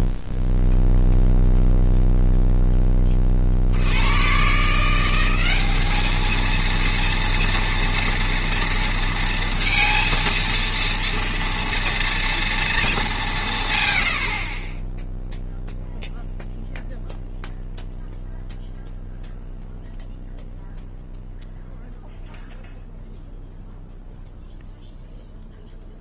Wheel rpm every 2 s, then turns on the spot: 0, 30, 170, 230, 230, 230, 210, 10, 0, 0, 0, 0, 0.
none